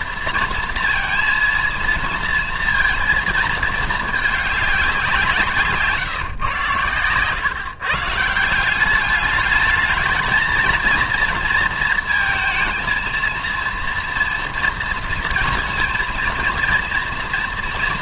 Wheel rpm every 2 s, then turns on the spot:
230, 230, 210, 120, 170, 230, 230, 230, 230.
none